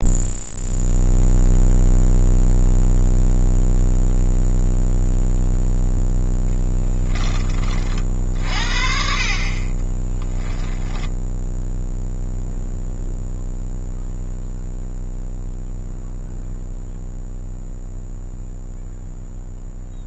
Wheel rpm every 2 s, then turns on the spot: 0, 0, 0, 10, 50, 10, 0, 0, 0, 0.
6-8